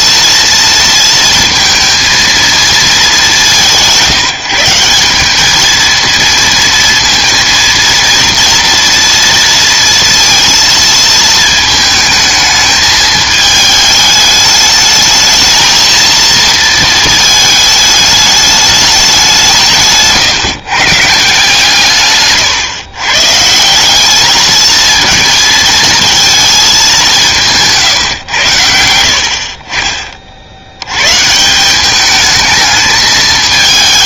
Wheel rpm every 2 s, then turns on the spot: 230, 230, 170, 230, 230, 230, 220, 210, 230, 210, 150, 130, 220, 220, 100, 70, 210.
none